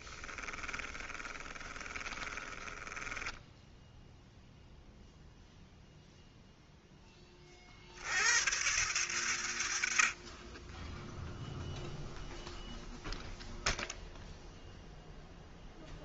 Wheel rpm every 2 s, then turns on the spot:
20, 20, 0, 0, 130, 10, 0, 0.
0-4